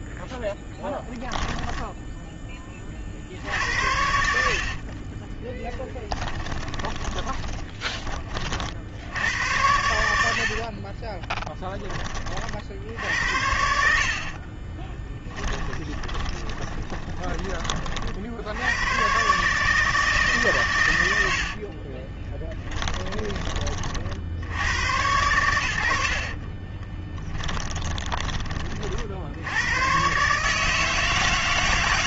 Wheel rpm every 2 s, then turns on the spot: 0, 30, 60, 20, 50, 50, 40, 30, 20, 80, 120, 20, 80, 40, 40, 150.
4-8 10-12 14-18 22-24 26-28